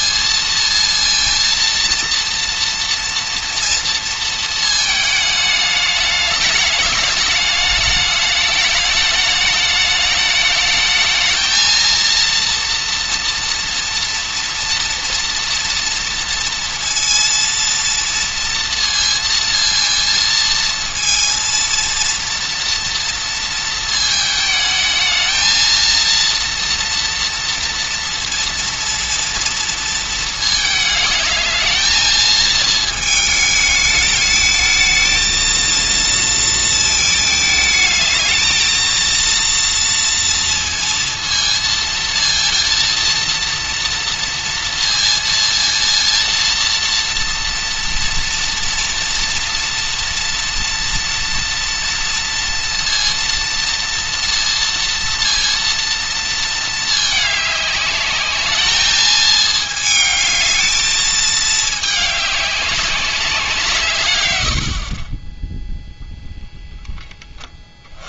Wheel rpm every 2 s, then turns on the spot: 230, 230, 220, 210, 210, 220, 230, 230, 230, 230, 230, 240, 220, 230, 230, 220, 220, 220, 230, 220, 230, 230, 230, 230, 230, 230, 230, 230, 220, 210, 220, 190, 60, 0.
64-66